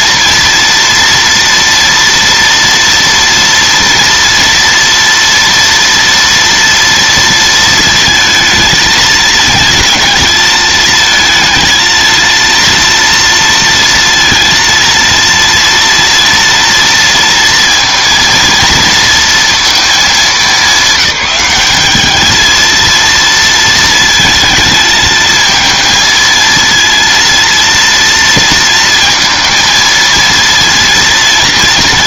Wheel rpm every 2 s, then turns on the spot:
230, 230, 230, 230, 220, 220, 230, 230, 230, 230, 200, 230, 220, 230, 220, 230.
none